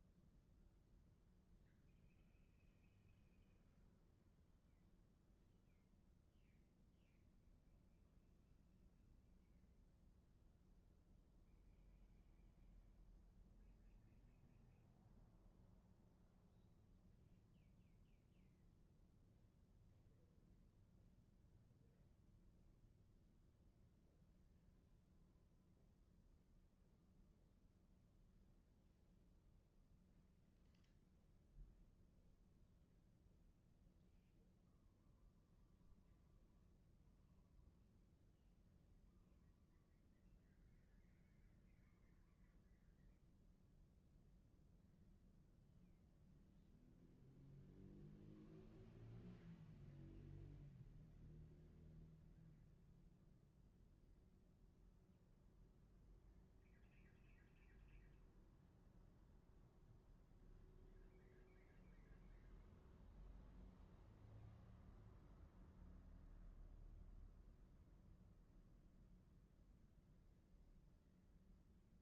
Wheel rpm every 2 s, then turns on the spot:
0, 0, 0, 0, 0, 0, 0, 0, 0, 0, 0, 0, 0, 0, 0, 0, 0, 0, 0, 0, 0, 0, 0, 0, 0, 0, 0, 0, 0, 0, 0, 0, 0, 0, 0, 0.
none